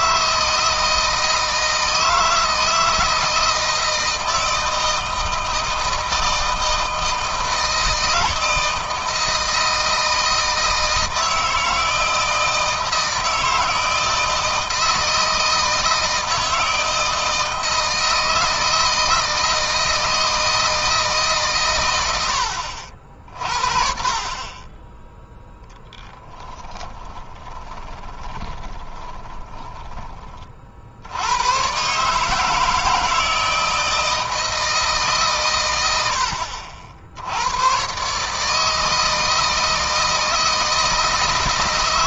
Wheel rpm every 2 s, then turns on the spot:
160, 160, 160, 160, 160, 160, 160, 170, 160, 160, 160, 60, 20, 10, 20, 50, 160, 150, 70, 160, 160.
26-30